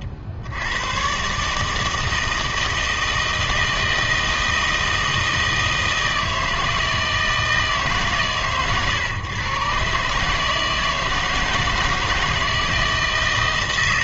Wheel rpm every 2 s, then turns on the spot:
80, 160, 160, 160, 110, 160, 160.
none